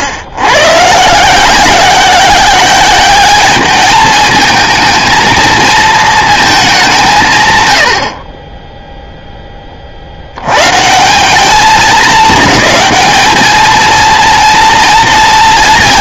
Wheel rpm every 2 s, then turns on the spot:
100, 190, 220, 210, 30, 80, 220, 230.
none